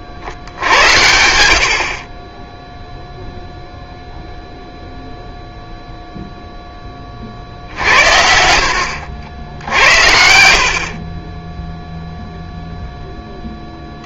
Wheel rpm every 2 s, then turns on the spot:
50, 10, 0, 0, 70, 70, 0.
10-12